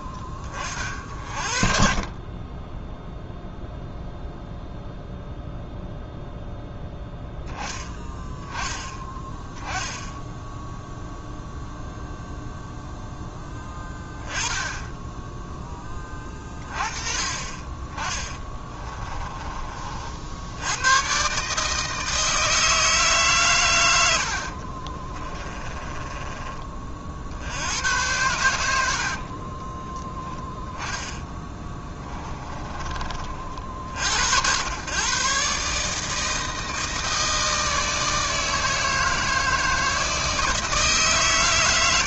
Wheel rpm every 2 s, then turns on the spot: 40, 10, 0, 0, 10, 0, 0, 10, 30, 20, 90, 160, 50, 30, 80, 10, 20, 110, 160, 160, 150.
18-20 24-26 28-30 32-34